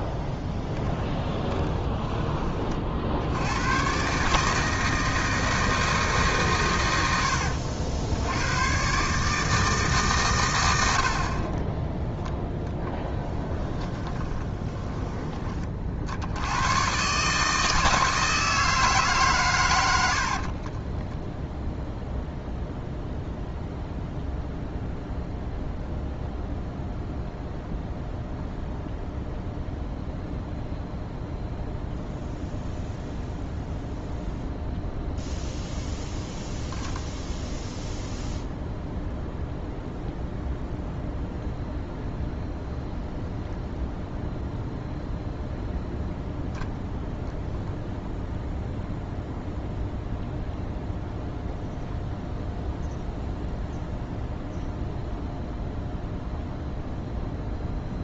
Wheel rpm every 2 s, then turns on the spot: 10, 50, 160, 120, 120, 90, 10, 20, 110, 160, 30, 0, 0, 0, 0, 0, 0, 0, 0, 0, 0, 0, 0, 0, 0, 0, 0, 0, 0.
12-14 20-22